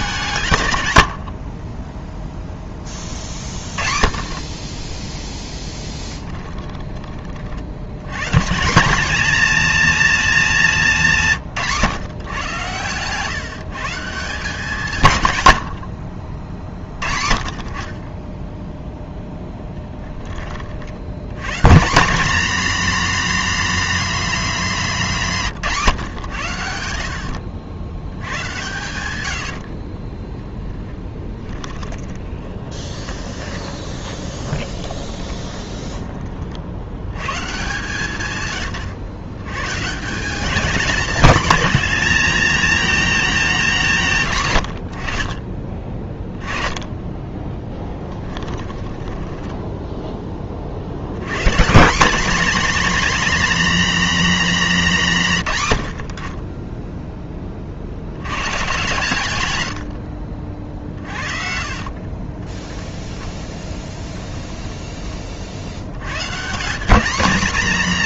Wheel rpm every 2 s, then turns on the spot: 120, 10, 20, 20, 200, 200, 120, 170, 40, 10, 60, 250, 200, 70, 100, 10, 10, 20, 70, 110, 220, 230, 80, 10, 20, 60, 250, 200, 10, 140, 40, 10, 10, 170.
6-8 28-36 48-50 60-64